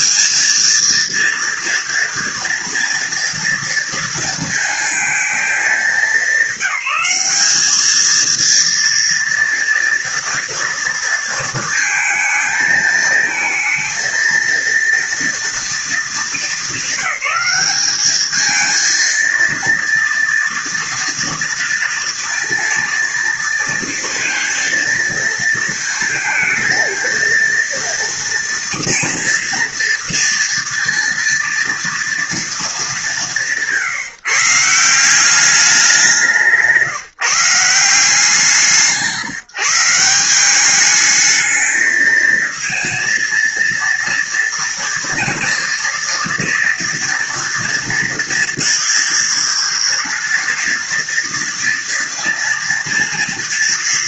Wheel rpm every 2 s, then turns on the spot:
230, 230, 220, 200, 230, 230, 220, 230, 200, 220, 230, 230, 230, 230, 230, 230, 190, 190, 160, 160, 210, 230, 240, 230, 230, 230, 230.
none